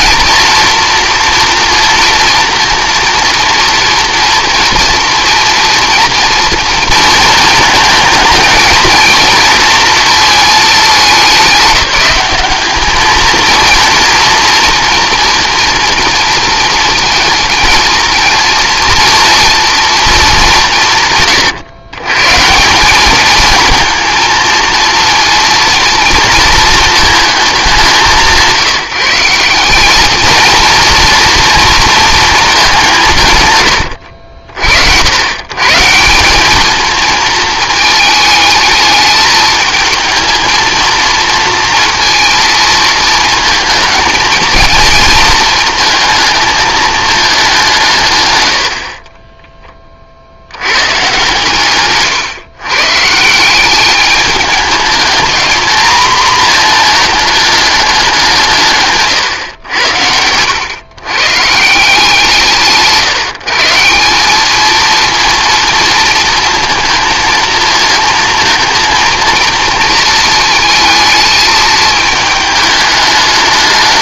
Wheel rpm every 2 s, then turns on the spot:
230, 230, 230, 230, 220, 220, 200, 230, 230, 230, 190, 160, 230, 230, 170, 230, 200, 60, 210, 220, 220, 230, 220, 220, 80, 100, 130, 210, 230, 160, 110, 160, 210, 230, 230, 230, 220.
none